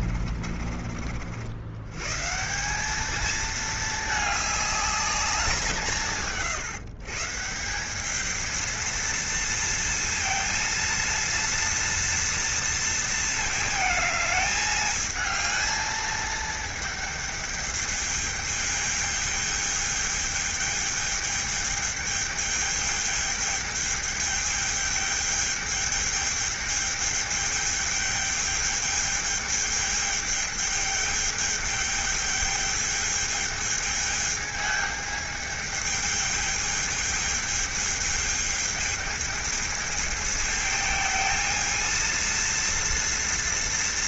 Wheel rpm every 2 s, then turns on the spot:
40, 200, 210, 130, 230, 230, 230, 220, 220, 210, 210, 210, 210, 210, 210, 210, 210, 210, 210, 220, 220, 230.
none